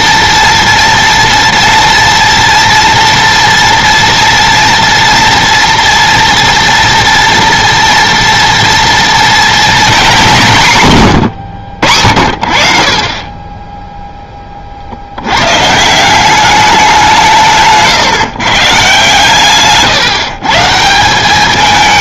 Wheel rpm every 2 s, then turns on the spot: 230, 230, 230, 230, 230, 150, 50, 50, 190, 150, 180.
none